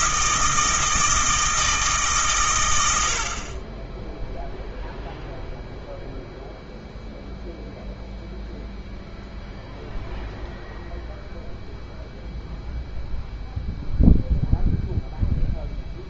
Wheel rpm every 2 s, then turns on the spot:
160, 100, 0, 0, 0, 0, 0, 0.
none